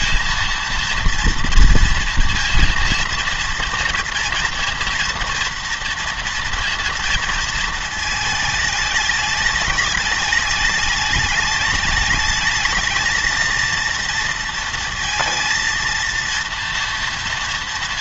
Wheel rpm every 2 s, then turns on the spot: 230, 230, 230, 230, 220, 210, 220, 230, 230.
none